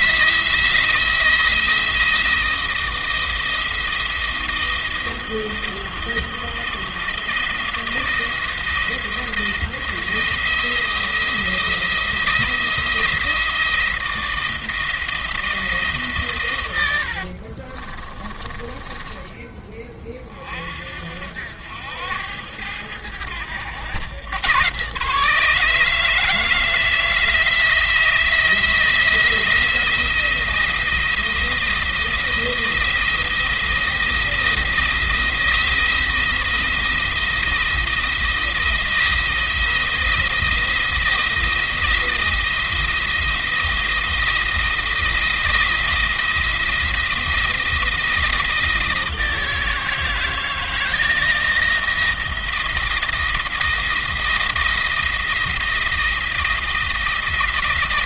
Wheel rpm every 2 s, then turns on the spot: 170, 170, 170, 170, 170, 170, 170, 160, 70, 20, 60, 90, 140, 160, 170, 170, 170, 160, 170, 170, 170, 170, 170, 170, 160, 160, 170, 170, 170.
16-18